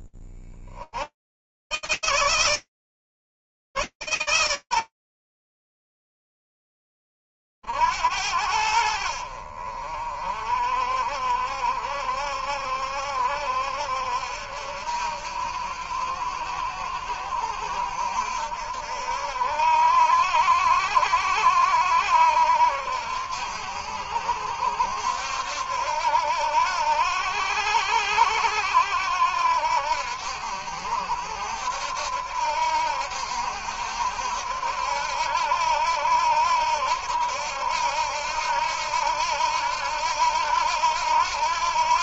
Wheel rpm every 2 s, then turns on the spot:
60, 160, 100, 20, 80, 60, 70, 70, 70, 70, 70, 80, 80, 80, 80, 80, 80, 80, 80, 80, 80.
none